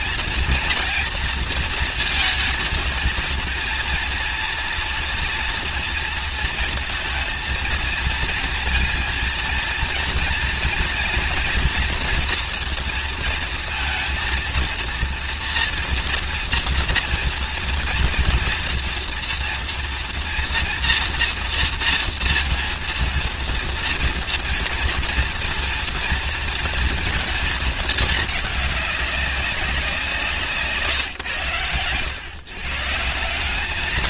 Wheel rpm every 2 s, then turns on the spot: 230, 230, 230, 230, 230, 230, 230, 230, 240, 230, 240, 230, 230, 230, 200, 150, 150.
none